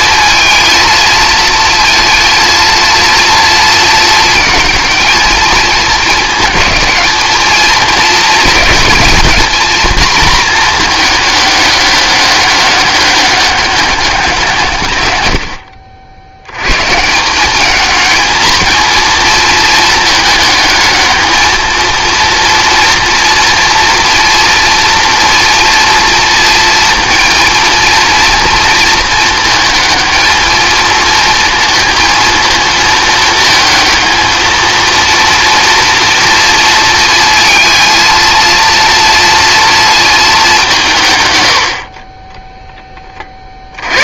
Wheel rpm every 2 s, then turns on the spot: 230, 230, 220, 220, 220, 230, 200, 170, 90, 220, 210, 230, 230, 230, 220, 220, 220, 220, 230, 230, 200, 20.
none